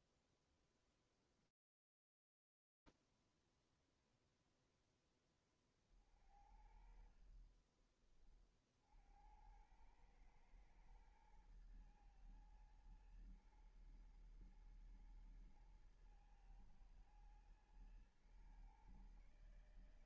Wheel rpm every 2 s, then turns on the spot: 0, 0, 0, 20, 30, 100, 110, 120, 110, 120.
none